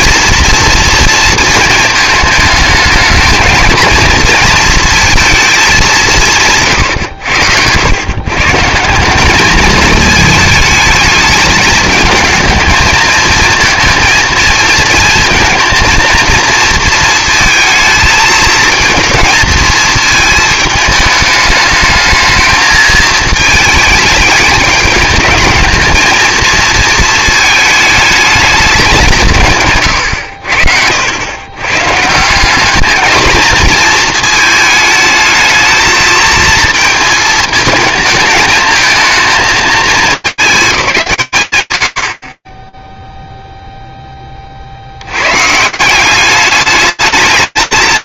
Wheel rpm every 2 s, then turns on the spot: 230, 220, 230, 140, 170, 220, 220, 230, 230, 230, 220, 220, 210, 230, 200, 70, 210, 220, 230, 230, 200, 20, 40, 210.
none